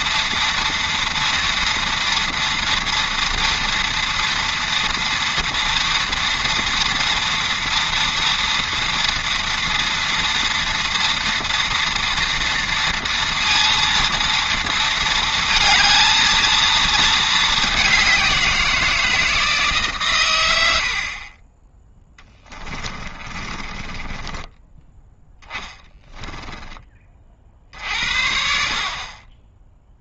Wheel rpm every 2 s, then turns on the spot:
230, 230, 230, 230, 230, 230, 230, 230, 220, 170, 70, 30, 10, 20, 50.
22-24